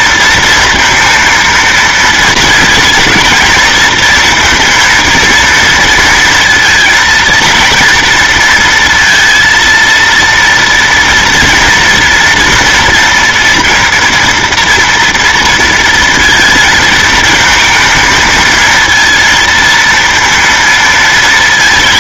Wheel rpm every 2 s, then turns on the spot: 230, 230, 230, 230, 230, 230, 230, 230, 230, 220, 230.
none